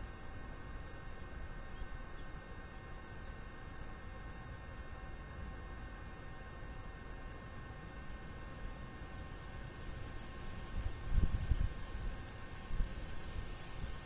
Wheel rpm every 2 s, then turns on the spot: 0, 0, 0, 0, 0, 0, 0.
none